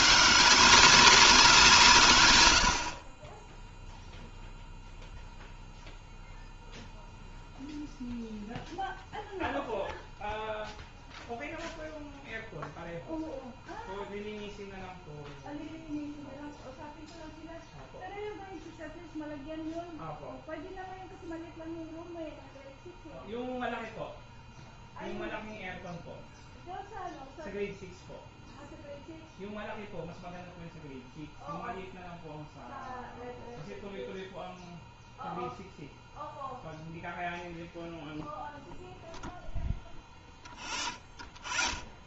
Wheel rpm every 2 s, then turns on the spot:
190, 50, 0, 0, 0, 0, 0, 0, 0, 0, 0, 0, 0, 0, 0, 0, 0, 0, 0, 0, 0.
none